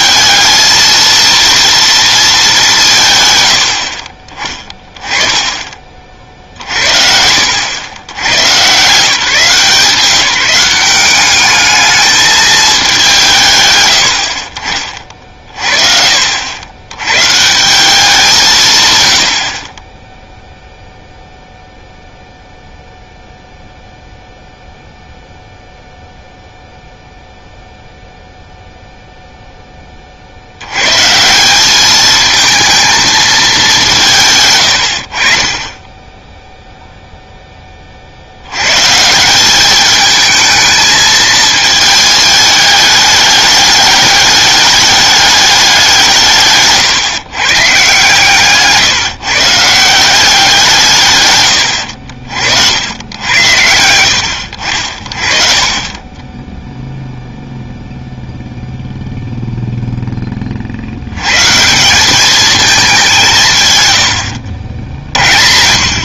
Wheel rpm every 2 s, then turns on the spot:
220, 200, 20, 50, 130, 180, 210, 50, 80, 150, 0, 0, 0, 0, 0, 90, 220, 100, 0, 110, 220, 210, 210, 160, 140, 170, 80, 60, 0, 0, 40, 210, 70.
none